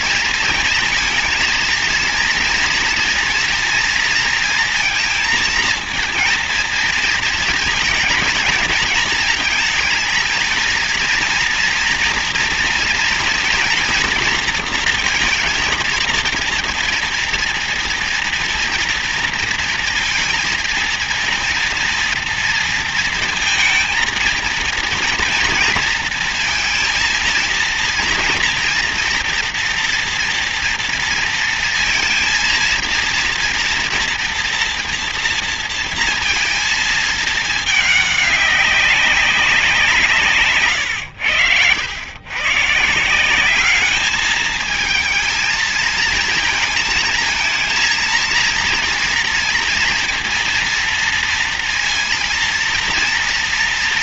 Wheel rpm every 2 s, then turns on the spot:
230, 230, 230, 230, 220, 220, 230, 230, 230, 230, 230, 230, 230, 230, 230, 230, 230, 230, 230, 200, 160, 110, 220, 220, 230, 230, 230.
none